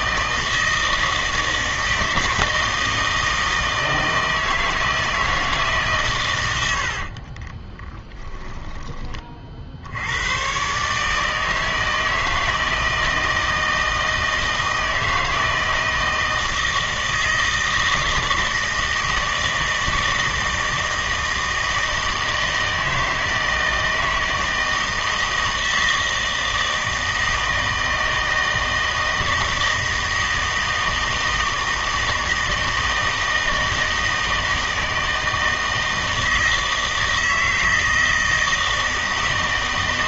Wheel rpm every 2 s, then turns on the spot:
160, 160, 160, 80, 10, 130, 160, 160, 160, 160, 160, 160, 160, 160, 160, 160, 160, 160, 160, 160.
6-8